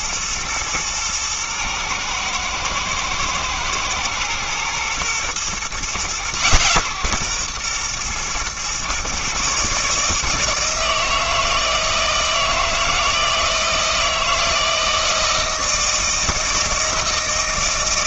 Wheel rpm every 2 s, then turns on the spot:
110, 110, 120, 130, 120, 160, 160, 160, 160.
none